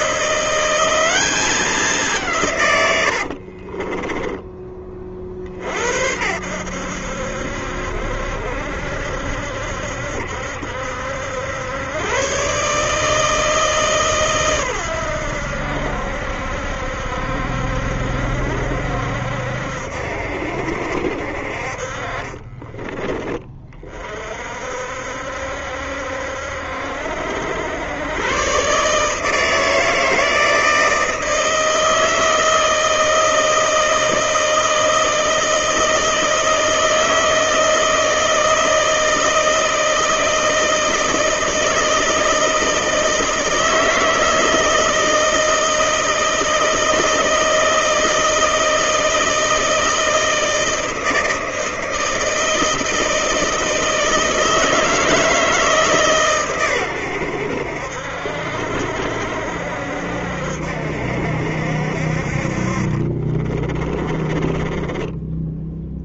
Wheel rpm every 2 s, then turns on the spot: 170, 160, 20, 70, 70, 70, 130, 130, 70, 70, 70, 30, 50, 70, 120, 160, 160, 160, 160, 160, 160, 160, 160, 160, 160, 160, 160, 160, 130, 70, 70, 50, 20.
4-6 22-24 64-66